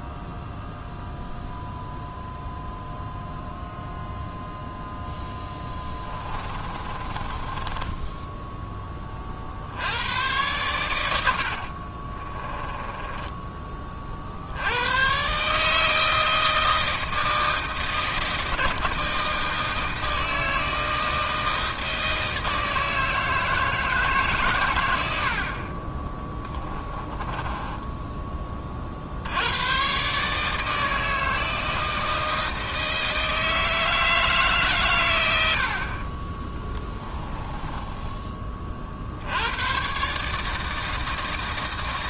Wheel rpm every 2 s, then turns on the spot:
0, 0, 0, 20, 10, 100, 10, 90, 160, 160, 160, 160, 110, 20, 40, 160, 160, 140, 20, 30, 160.
6-8 12-14 26-28 36-38